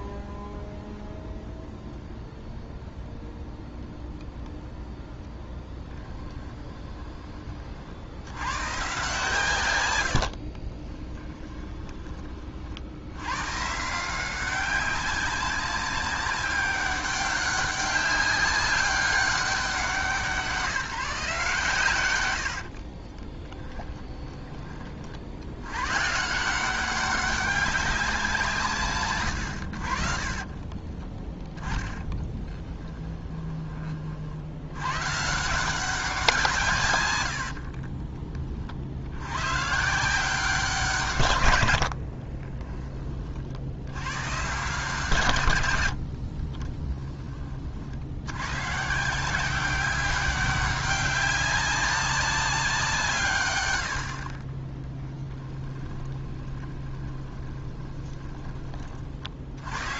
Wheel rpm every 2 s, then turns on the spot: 0, 0, 0, 20, 130, 40, 70, 190, 190, 190, 180, 50, 30, 180, 140, 30, 20, 90, 150, 60, 170, 20, 140, 20, 140, 200, 180, 20, 20, 20.
10-12 22-24 30-34 46-48 56-58